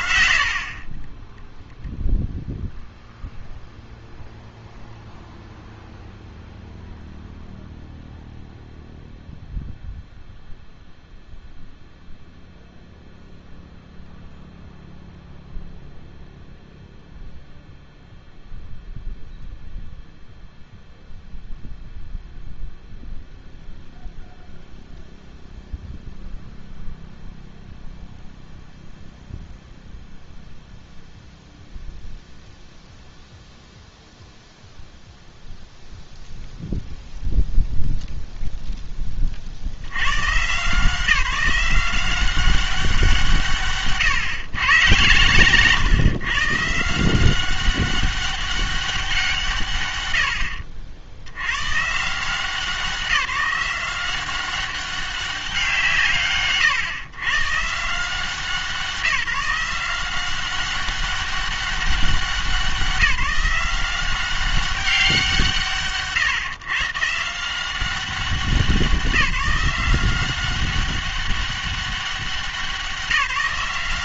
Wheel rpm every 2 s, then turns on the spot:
50, 0, 0, 0, 0, 0, 0, 0, 0, 0, 0, 0, 0, 0, 0, 0, 0, 0, 0, 0, 140, 190, 120, 150, 200, 70, 180, 190, 130, 170, 190, 190, 190, 130, 190, 190, 180.
none